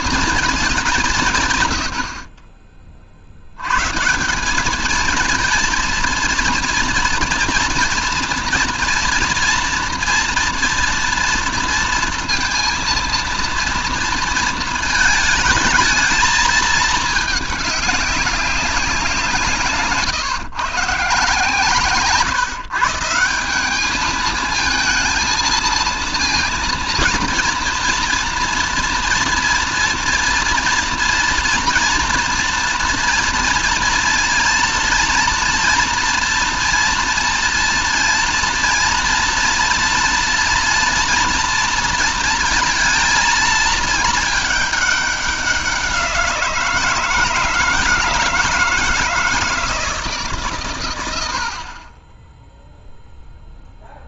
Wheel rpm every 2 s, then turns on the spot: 190, 30, 210, 230, 230, 240, 230, 220, 220, 180, 140, 160, 220, 220, 230, 230, 230, 230, 230, 230, 230, 230, 210, 160, 160, 120, 0.
none